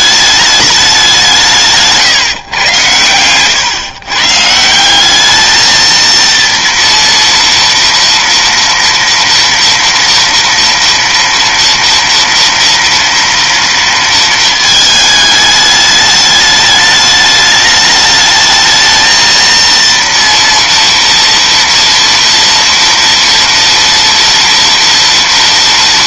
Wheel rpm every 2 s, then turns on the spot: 210, 140, 140, 230, 230, 230, 230, 230, 210, 210, 230, 230, 230.
none